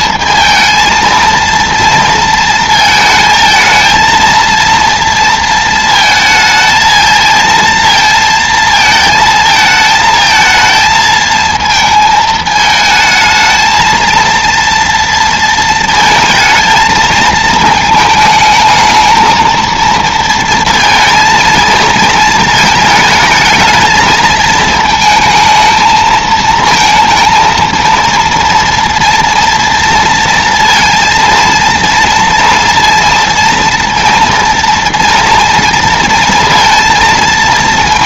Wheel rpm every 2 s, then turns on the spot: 230, 230, 230, 220, 220, 220, 220, 230, 230, 220, 230, 220, 220, 230, 230, 230, 230, 230, 230.
none